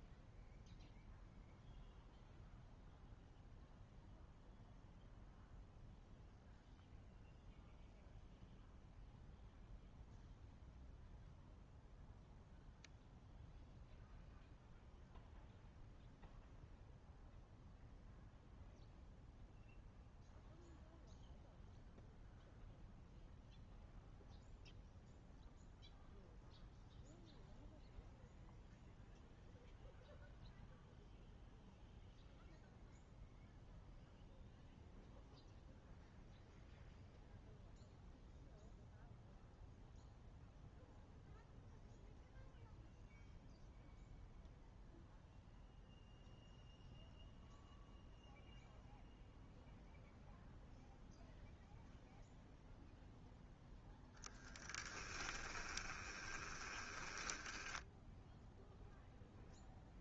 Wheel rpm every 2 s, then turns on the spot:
0, 0, 0, 0, 0, 0, 0, 0, 0, 0, 0, 0, 0, 0, 0, 0, 0, 0, 0, 0, 0, 0, 0, 0, 0, 0, 0, 10, 20, 0.
54-58